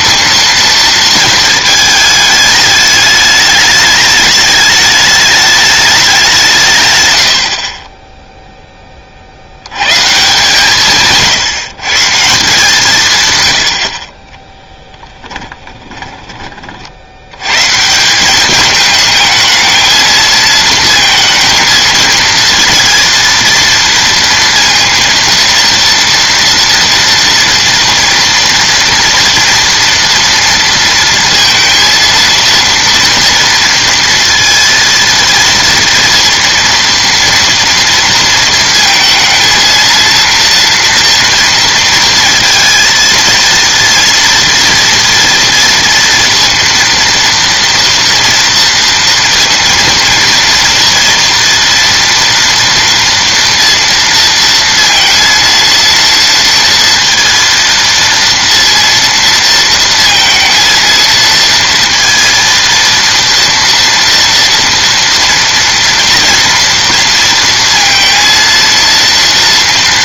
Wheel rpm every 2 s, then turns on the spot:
230, 210, 210, 140, 10, 150, 180, 10, 50, 210, 230, 230, 230, 230, 240, 230, 230, 230, 230, 230, 230, 230, 230, 230, 230, 230, 230, 230, 230, 230, 230, 230, 240, 230, 230.
14-16